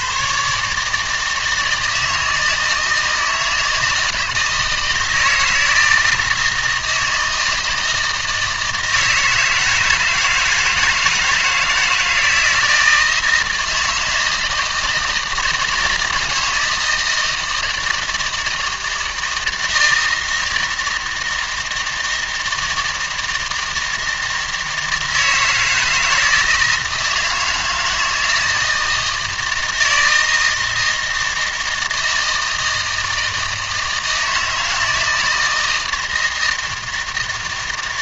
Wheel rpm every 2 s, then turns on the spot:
150, 160, 160, 160, 160, 160, 160, 160, 160, 160, 160, 160, 160, 160, 160, 160, 160, 160, 160.
none